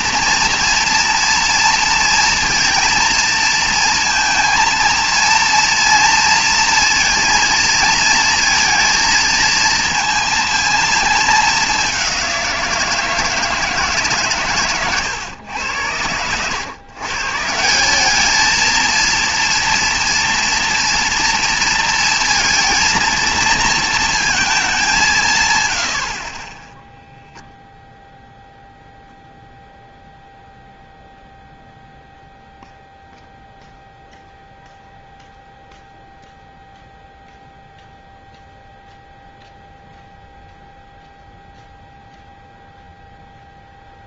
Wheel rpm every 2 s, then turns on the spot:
230, 230, 230, 230, 230, 230, 170, 130, 110, 220, 230, 230, 210, 20, 0, 0, 0, 0, 0, 0, 0, 0.
none